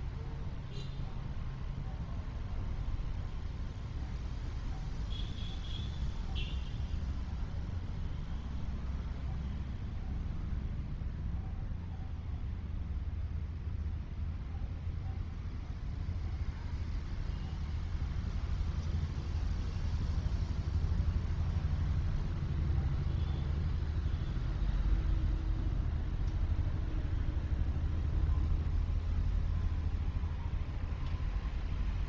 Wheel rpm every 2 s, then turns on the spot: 0, 0, 0, 0, 0, 0, 0, 0, 0, 0, 0, 0, 0, 0, 0, 0.
none